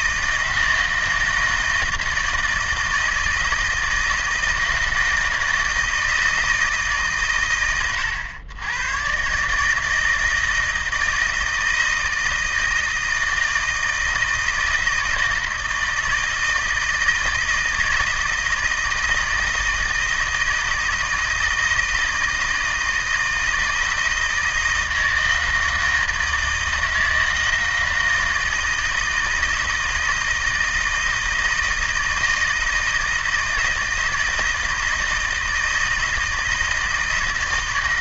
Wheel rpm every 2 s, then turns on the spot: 160, 160, 160, 150, 120, 160, 160, 160, 160, 160, 160, 160, 160, 160, 160, 160, 160, 160, 160.
none